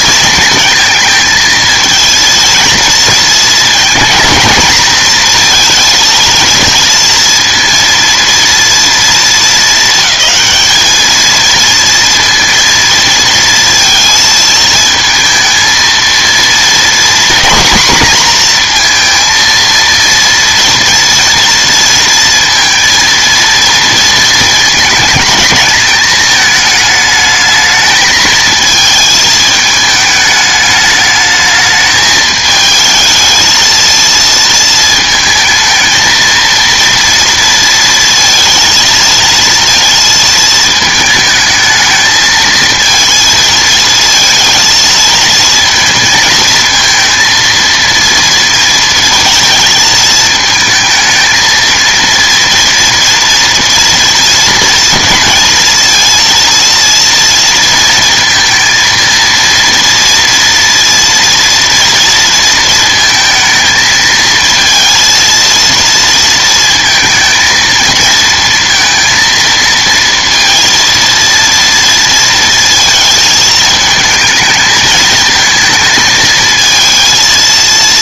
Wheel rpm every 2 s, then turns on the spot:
230, 230, 220, 230, 230, 220, 230, 220, 230, 230, 230, 230, 220, 220, 220, 210, 220, 220, 230, 230, 220, 220, 220, 220, 230, 220, 230, 230, 230, 230, 230, 220, 230, 230, 230, 230, 220, 220, 220.
none